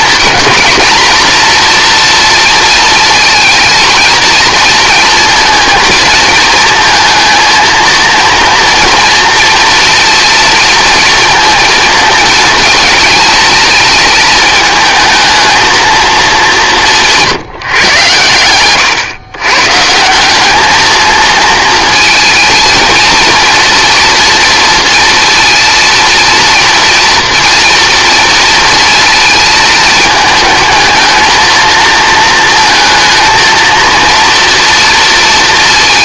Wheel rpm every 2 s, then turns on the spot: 230, 230, 230, 230, 230, 230, 230, 220, 190, 120, 210, 220, 230, 230, 230, 220, 220, 230.
none